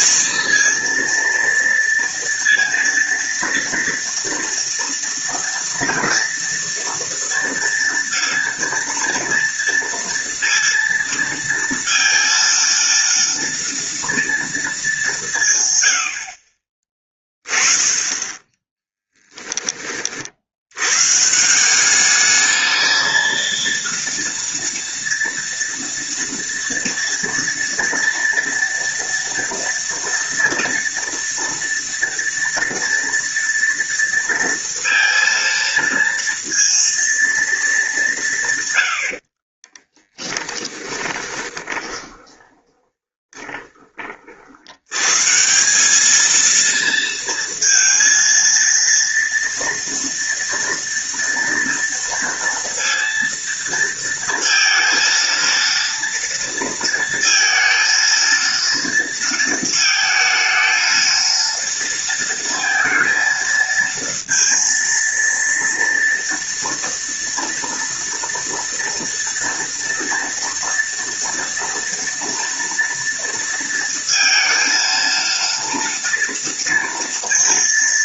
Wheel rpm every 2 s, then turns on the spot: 230, 230, 230, 230, 230, 230, 230, 150, 30, 10, 150, 230, 230, 230, 230, 230, 230, 230, 230, 60, 20, 20, 130, 230, 230, 230, 230, 230, 230, 230, 230, 230, 230, 230, 230, 230, 230, 230, 230.
38-44